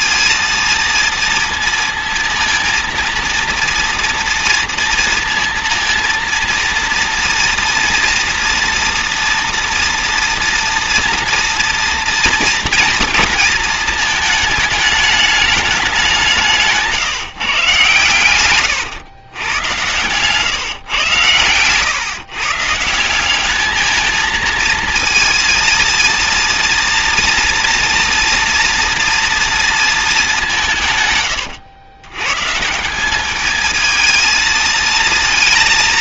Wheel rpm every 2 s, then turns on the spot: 230, 230, 230, 230, 230, 240, 230, 220, 160, 120, 140, 150, 230, 230, 240, 180, 150, 220.
none